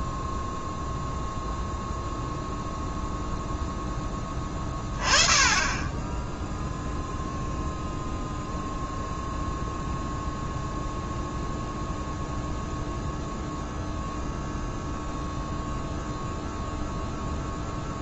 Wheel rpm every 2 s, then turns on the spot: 0, 0, 20, 0, 0, 0, 0, 0, 0.
none